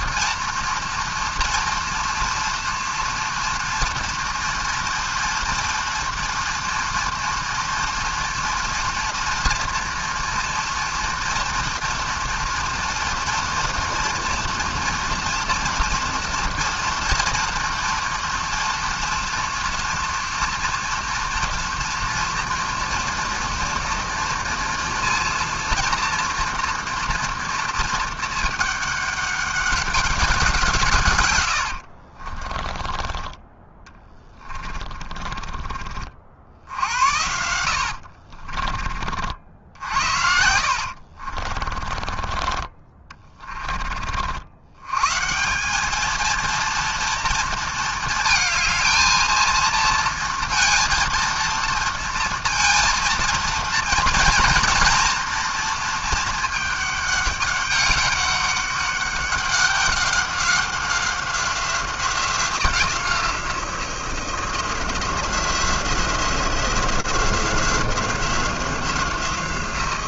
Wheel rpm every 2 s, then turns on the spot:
230, 240, 230, 230, 230, 230, 230, 230, 230, 240, 230, 230, 230, 230, 220, 180, 30, 30, 60, 40, 60, 30, 80, 230, 220, 230, 230, 230, 220, 200, 190, 180, 170, 170, 180.
32-36 38-44